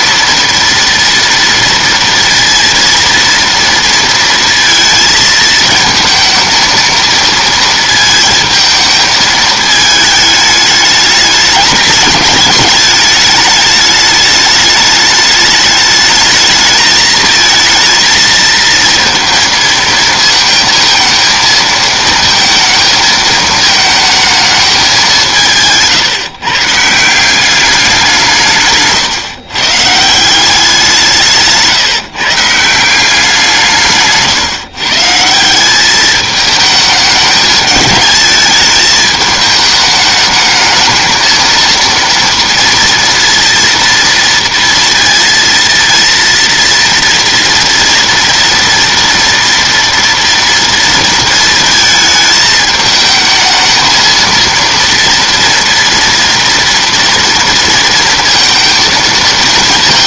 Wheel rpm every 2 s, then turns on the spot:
230, 230, 230, 230, 220, 210, 210, 210, 220, 230, 220, 220, 210, 150, 150, 170, 160, 140, 210, 210, 220, 230, 230, 230, 230, 230, 220, 230, 230, 230.
none